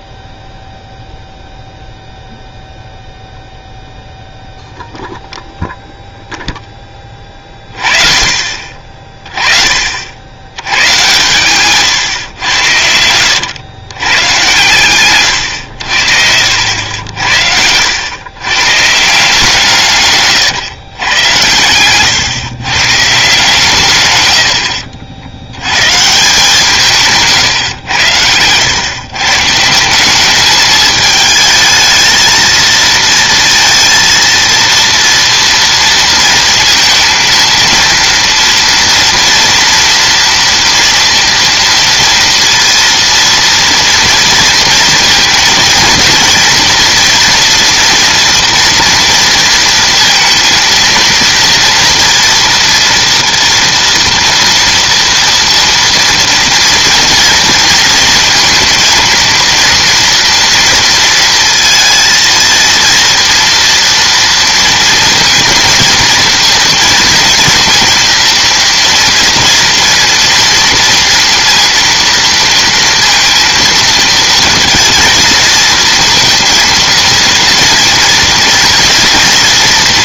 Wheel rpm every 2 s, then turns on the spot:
0, 0, 0, 10, 50, 100, 90, 120, 70, 120, 130, 130, 80, 150, 100, 210, 230, 230, 230, 230, 240, 230, 230, 230, 230, 230, 230, 230, 230, 220, 230, 230, 230, 230, 230, 230, 230, 230, 230, 230.
none